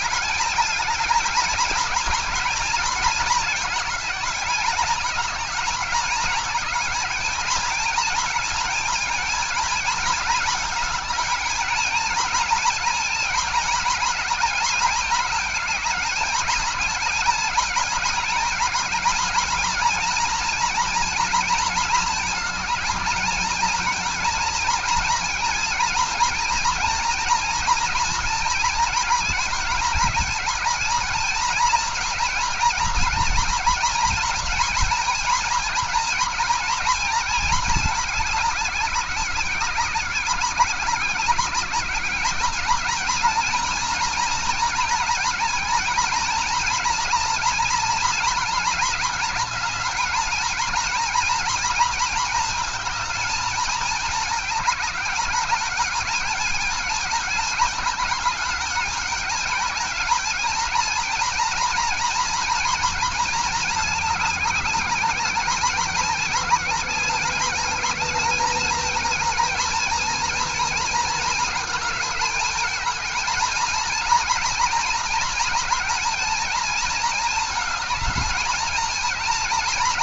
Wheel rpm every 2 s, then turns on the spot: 220, 210, 210, 220, 230, 220, 230, 220, 210, 220, 230, 220, 230, 230, 220, 230, 230, 230, 220, 190, 190, 230, 230, 230, 210, 240, 230, 200, 220, 210, 230, 220, 210, 210, 220, 220, 220, 230, 220, 230.
none